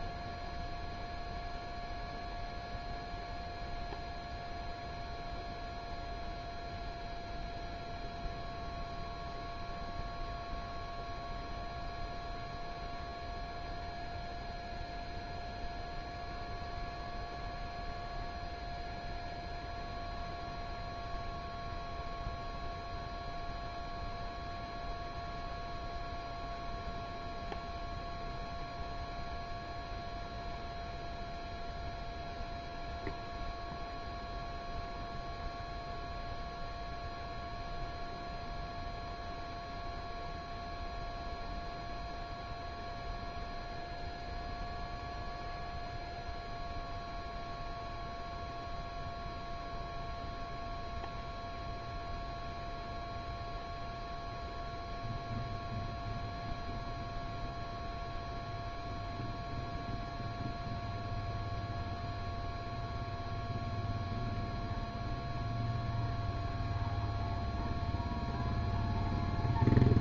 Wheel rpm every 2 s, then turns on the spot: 0, 0, 0, 0, 0, 0, 0, 0, 0, 0, 0, 0, 0, 0, 0, 0, 0, 0, 0, 0, 0, 0, 0, 0, 0, 0, 0, 0, 0, 0, 0, 0, 0, 0, 0.
none